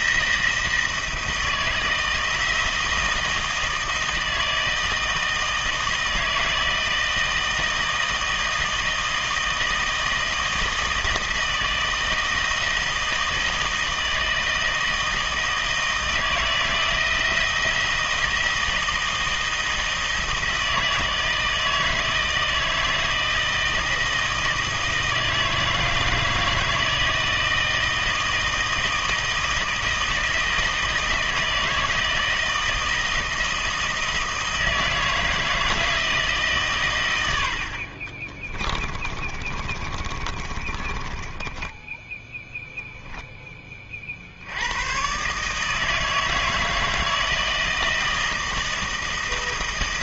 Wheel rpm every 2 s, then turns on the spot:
160, 170, 160, 160, 160, 160, 160, 160, 160, 160, 160, 160, 160, 160, 160, 160, 160, 160, 130, 30, 30, 0, 110, 160, 160.
38-42